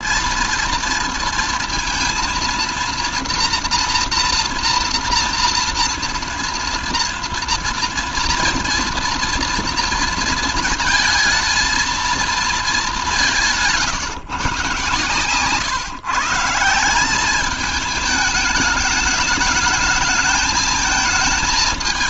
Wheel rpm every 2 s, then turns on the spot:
230, 240, 230, 230, 240, 230, 210, 130, 170, 210, 220.
none